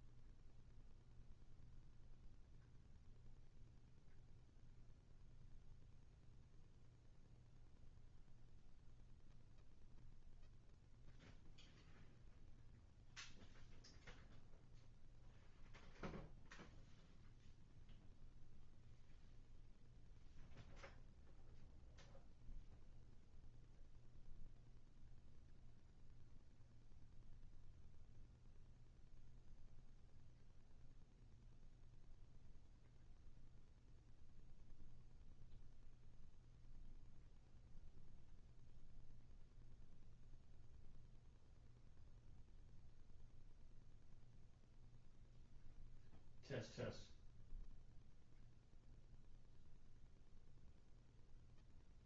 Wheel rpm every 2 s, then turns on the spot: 0, 0, 0, 0, 0, 0, 0, 0, 0, 0, 0, 0, 0, 0, 0, 0, 0, 0, 0, 0, 0, 0, 0, 0, 0, 0.
none